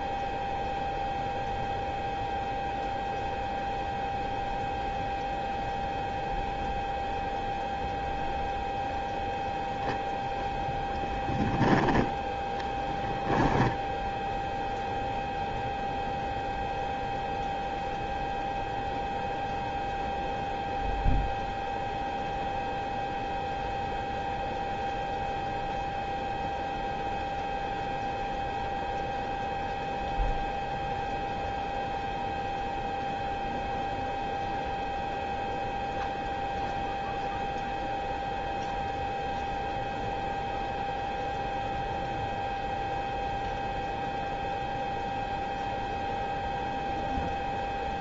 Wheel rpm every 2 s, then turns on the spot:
0, 0, 0, 0, 0, 0, 10, 0, 0, 0, 0, 0, 0, 0, 0, 0, 0, 0, 0, 0, 0, 0, 0, 0.
none